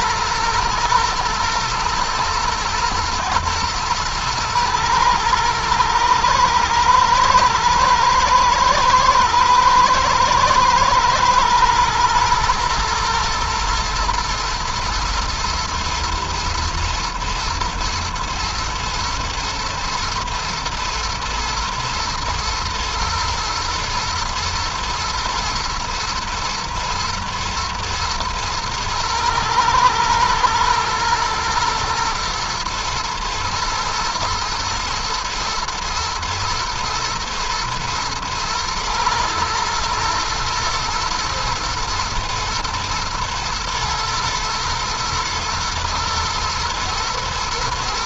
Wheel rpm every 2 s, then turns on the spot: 110, 120, 110, 110, 110, 110, 120, 120, 110, 110, 110, 120, 110, 120, 120, 110, 110, 110, 110, 110, 110, 120, 120, 110.
none